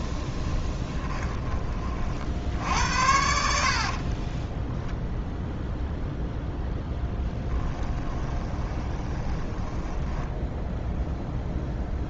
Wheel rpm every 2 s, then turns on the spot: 20, 70, 0, 10, 20, 10.
0-2 8-10